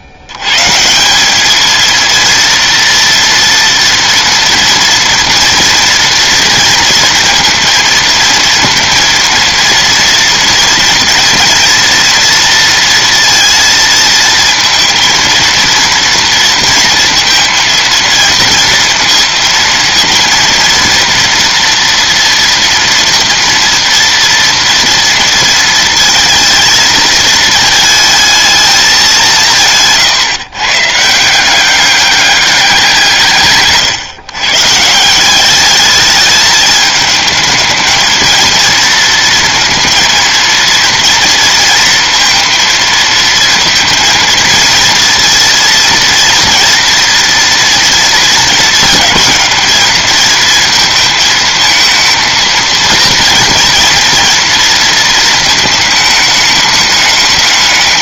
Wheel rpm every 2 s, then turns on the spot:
60, 230, 240, 230, 230, 230, 230, 220, 230, 230, 230, 230, 230, 220, 220, 150, 200, 140, 210, 220, 230, 230, 230, 230, 230, 220, 230, 230, 210.
none